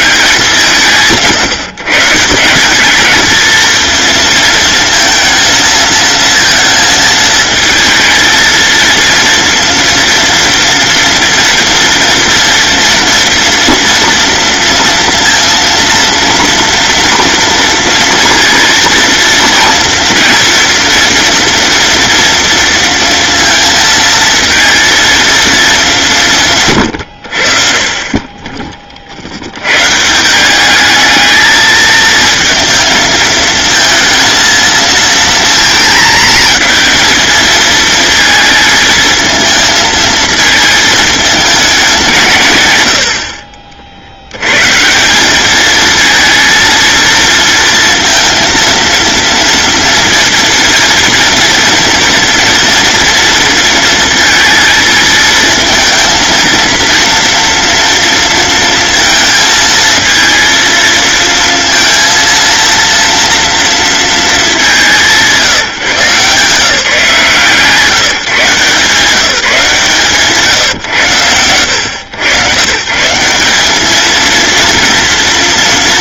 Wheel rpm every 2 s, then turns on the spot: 160, 200, 230, 220, 230, 230, 230, 230, 240, 230, 230, 230, 220, 130, 30, 200, 230, 230, 230, 220, 220, 100, 120, 230, 230, 230, 230, 220, 230, 230, 230, 230, 200, 160, 150, 150, 120, 230.
42-44